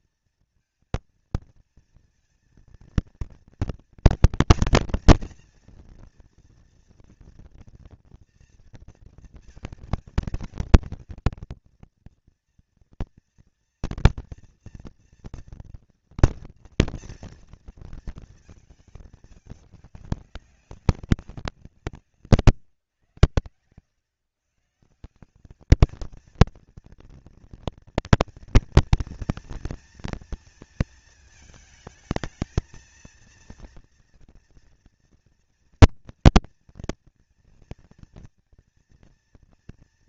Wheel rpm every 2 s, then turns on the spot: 230, 230, 240, 240, 230, 230, 230, 230, 230, 210, 200, 120, 160, 230, 230, 220, 220, 230, 230, 230.
none